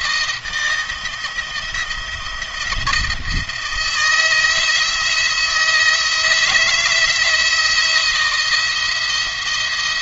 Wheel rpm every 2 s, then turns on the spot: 170, 170, 170, 160, 160.
none